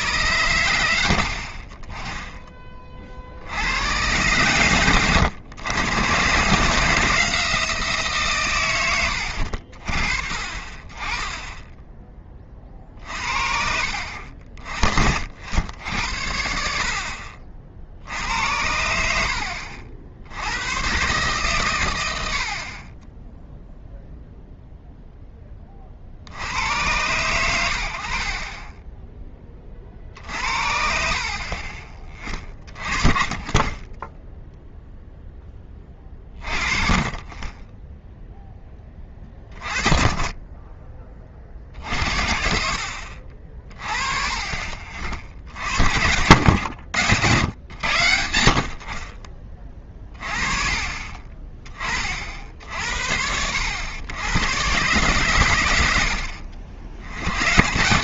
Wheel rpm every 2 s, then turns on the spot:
120, 30, 120, 150, 120, 40, 40, 50, 70, 70, 100, 60, 0, 80, 20, 60, 30, 0, 30, 10, 20, 50, 30, 100, 60, 30, 60, 120, 70.
32-34 44-48